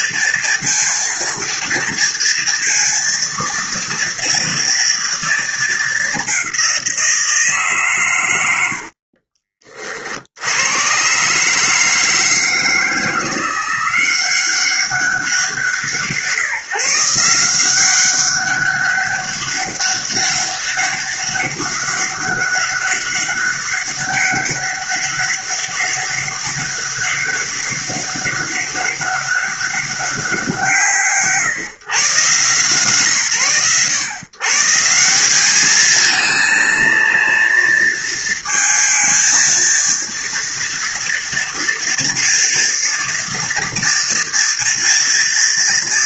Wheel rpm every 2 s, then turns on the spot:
230, 230, 230, 190, 80, 90, 160, 190, 160, 200, 200, 200, 200, 200, 200, 160, 140, 150, 230, 230, 230, 230, 230.
8-10